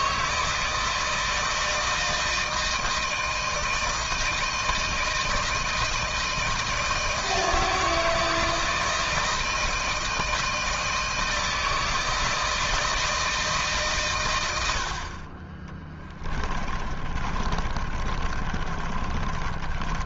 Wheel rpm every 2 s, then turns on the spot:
160, 160, 160, 160, 160, 160, 160, 50, 30, 30.
16-20